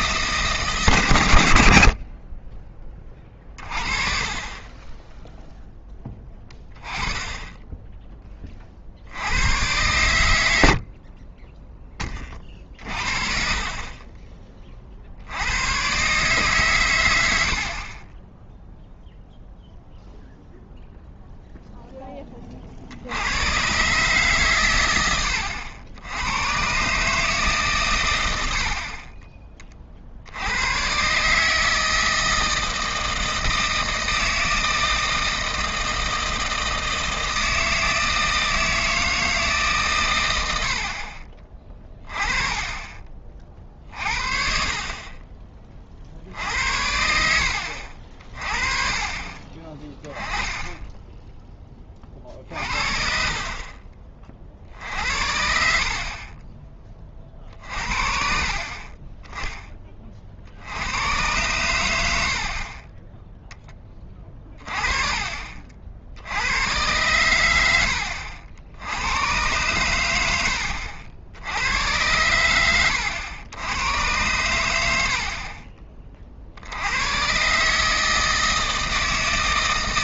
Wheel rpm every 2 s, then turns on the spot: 150, 20, 20, 20, 50, 60, 40, 40, 120, 0, 0, 70, 120, 130, 50, 100, 160, 160, 160, 160, 70, 20, 50, 70, 30, 10, 50, 50, 30, 40, 80, 40, 30, 100, 80, 80, 100, 100, 70, 160.
42-44 64-66